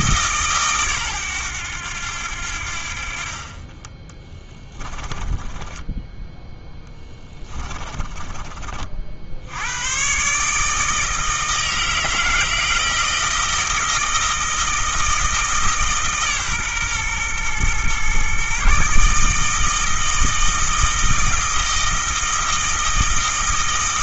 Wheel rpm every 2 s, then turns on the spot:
130, 60, 20, 10, 50, 160, 160, 160, 130, 150, 160, 160.
4-8